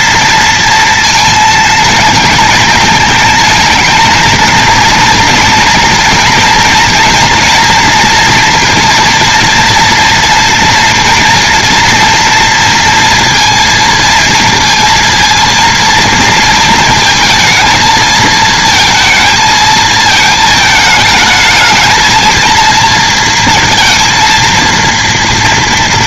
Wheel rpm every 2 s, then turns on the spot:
230, 230, 230, 230, 240, 240, 230, 230, 230, 220, 220, 230, 230.
none